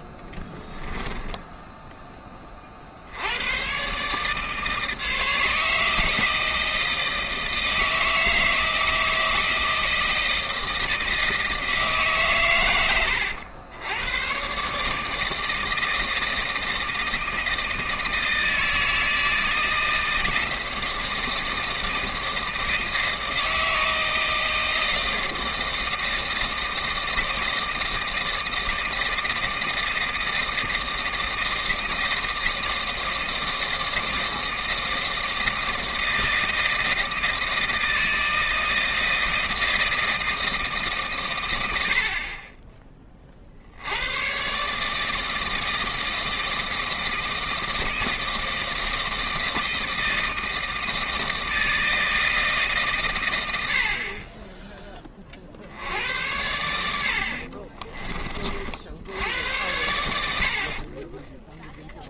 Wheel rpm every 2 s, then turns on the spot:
10, 50, 150, 160, 160, 160, 110, 140, 160, 160, 160, 160, 160, 160, 160, 160, 160, 160, 160, 160, 150, 20, 140, 160, 160, 160, 140, 10, 80, 60, 60.
0-2